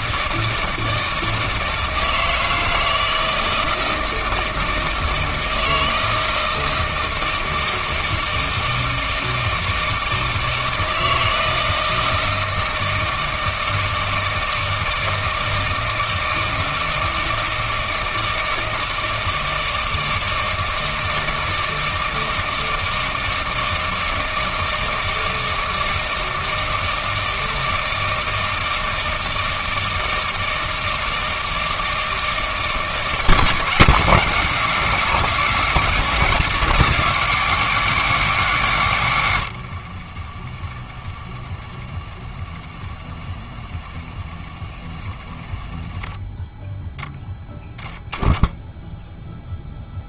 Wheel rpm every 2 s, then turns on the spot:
160, 160, 160, 160, 160, 160, 160, 160, 160, 160, 160, 160, 160, 160, 160, 160, 160, 160, 170, 150, 30, 20, 30, 0, 10.
none